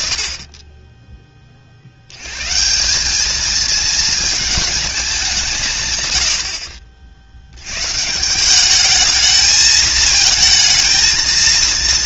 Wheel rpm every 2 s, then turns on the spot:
60, 230, 110, 160, 220, 230.
none